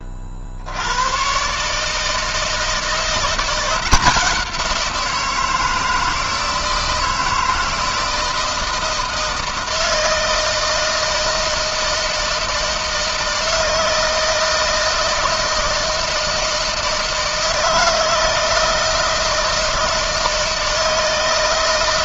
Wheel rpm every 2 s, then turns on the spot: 110, 170, 170, 160, 160, 160, 160, 160, 160, 160, 160.
none